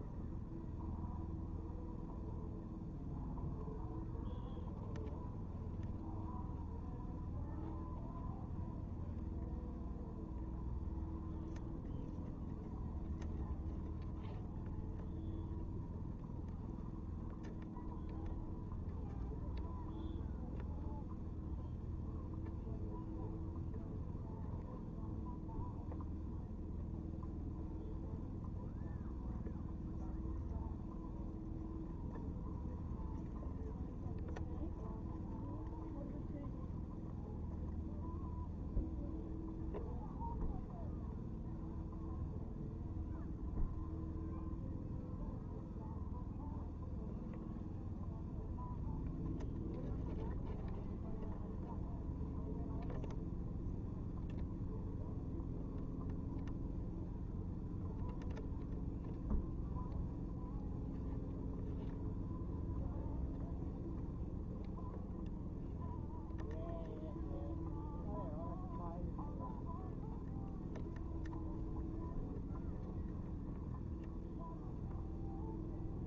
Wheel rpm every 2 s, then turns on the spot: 0, 0, 0, 0, 0, 0, 0, 0, 0, 0, 0, 0, 0, 0, 0, 0, 0, 0, 0, 0, 0, 0, 0, 0, 0, 0, 0, 0, 0, 0, 0, 0, 0, 0, 0, 0, 0, 0.
none